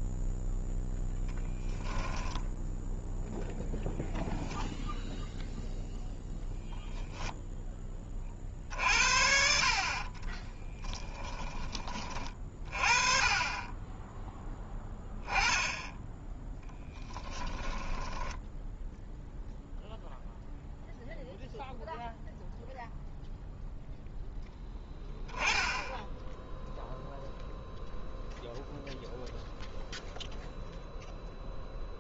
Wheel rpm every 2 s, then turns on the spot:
0, 10, 0, 10, 50, 10, 30, 10, 10, 10, 0, 0, 0, 0, 0, 0.
10-12